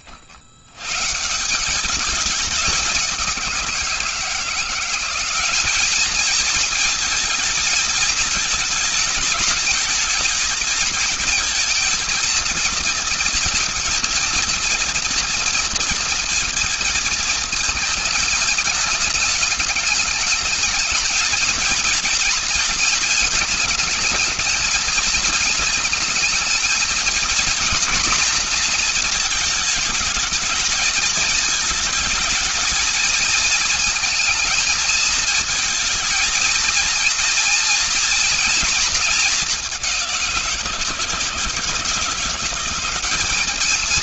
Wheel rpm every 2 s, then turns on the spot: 170, 180, 200, 220, 220, 230, 230, 230, 230, 210, 230, 220, 230, 230, 220, 220, 220, 220, 220, 210, 170, 210.
none